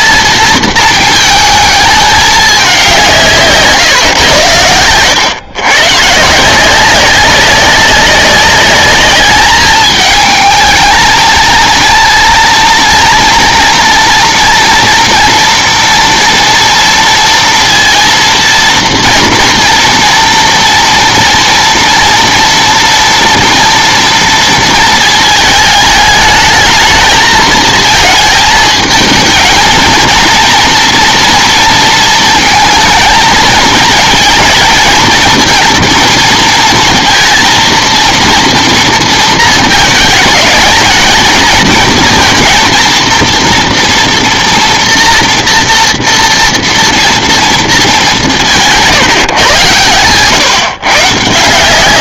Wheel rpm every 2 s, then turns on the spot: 230, 200, 100, 170, 200, 220, 230, 240, 230, 230, 240, 230, 230, 220, 220, 230, 220, 220, 230, 230, 210, 230, 230, 230, 170, 140.
none